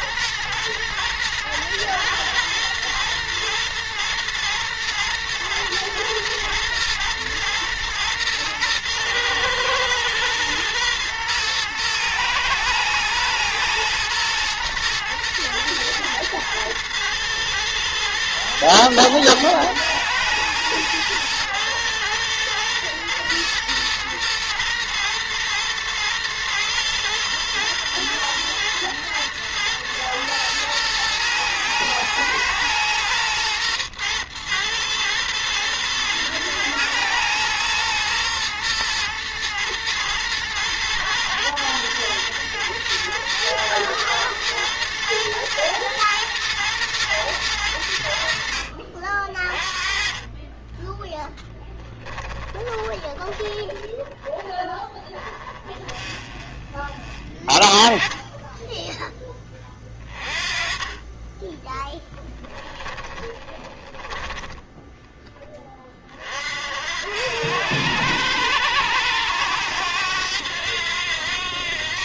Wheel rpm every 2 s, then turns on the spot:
120, 110, 120, 120, 110, 120, 110, 110, 110, 110, 110, 110, 120, 110, 110, 110, 110, 120, 110, 110, 110, 120, 110, 120, 70, 20, 10, 10, 20, 10, 30, 10, 10, 50, 100, 90.
52-54 64-66